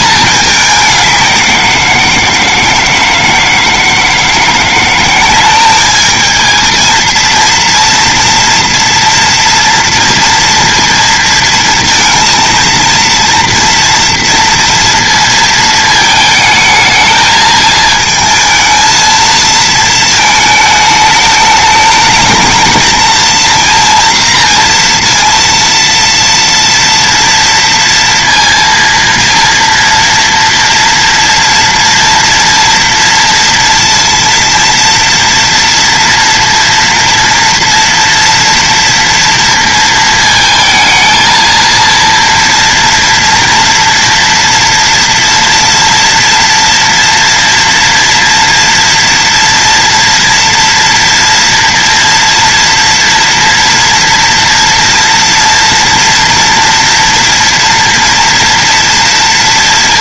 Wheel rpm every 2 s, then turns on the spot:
210, 160, 170, 210, 240, 230, 230, 230, 220, 220, 220, 220, 230, 230, 230, 230, 240, 230, 230, 230, 230, 230, 230, 230, 230, 230, 240, 230, 230, 230.
none